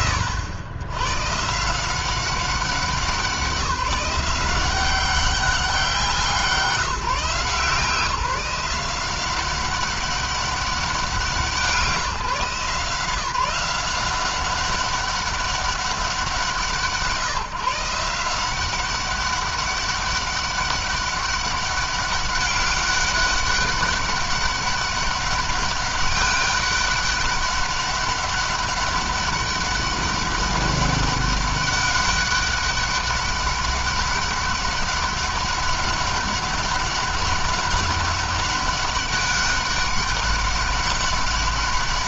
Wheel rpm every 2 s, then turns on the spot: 90, 190, 190, 160, 180, 180, 160, 190, 170, 180, 200, 190, 200, 200, 200, 200, 200, 200, 200, 200, 200.
none